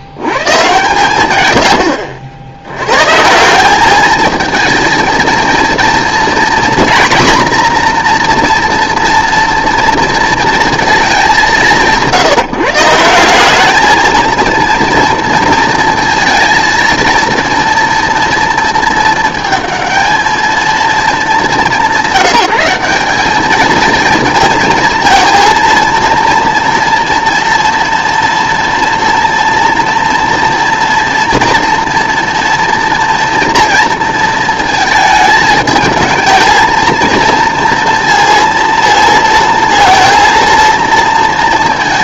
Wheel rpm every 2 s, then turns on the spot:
130, 100, 220, 240, 240, 220, 160, 230, 230, 220, 220, 190, 220, 230, 240, 230, 230, 220, 230, 230, 230.
none